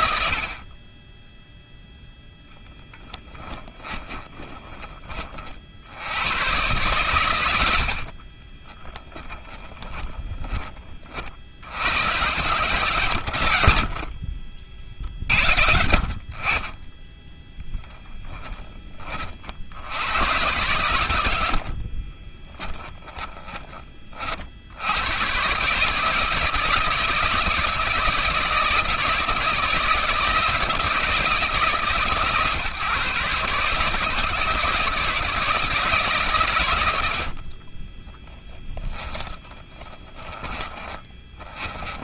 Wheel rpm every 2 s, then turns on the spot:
30, 10, 30, 100, 10, 40, 120, 70, 30, 30, 90, 30, 100, 160, 160, 160, 140, 160, 70, 10, 20.
2-4 8-10 12-14 20-24 38-42